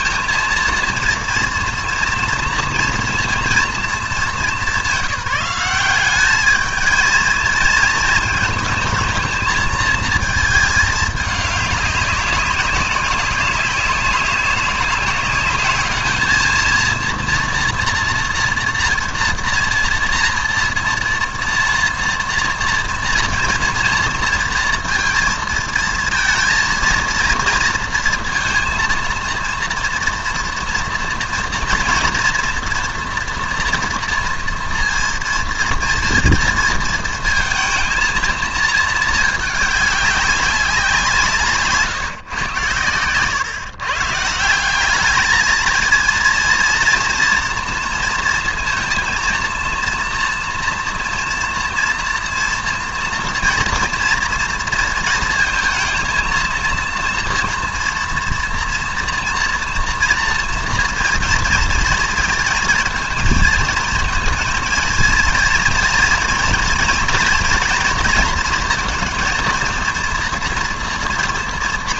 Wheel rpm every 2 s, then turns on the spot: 230, 230, 200, 220, 230, 220, 190, 190, 230, 240, 230, 230, 230, 230, 230, 230, 240, 230, 230, 220, 190, 120, 190, 230, 230, 240, 230, 230, 230, 240, 230, 220, 230, 230, 230, 230.
none